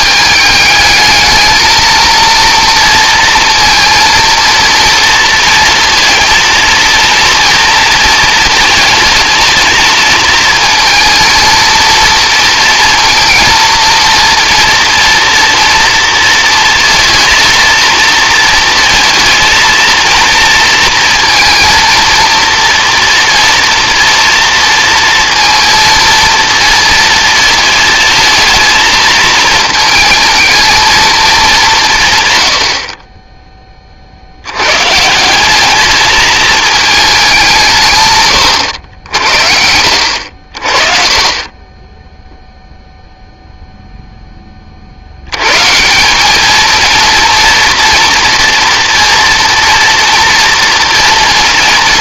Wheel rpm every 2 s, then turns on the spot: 220, 230, 230, 230, 220, 230, 230, 240, 230, 230, 230, 230, 230, 230, 220, 220, 40, 120, 220, 90, 40, 0, 20, 220, 230, 240.
none